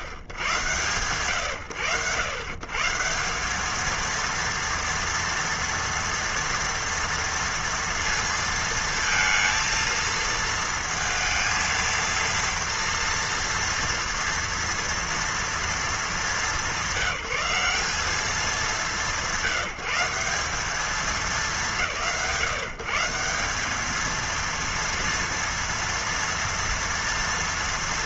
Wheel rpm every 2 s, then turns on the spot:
110, 110, 230, 230, 230, 230, 230, 230, 200, 190, 200, 150, 230, 230.
none